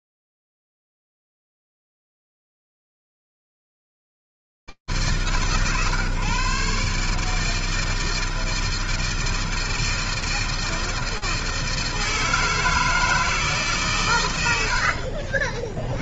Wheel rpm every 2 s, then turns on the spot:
60, 160, 160, 120, 150, 160, 160, 150.
none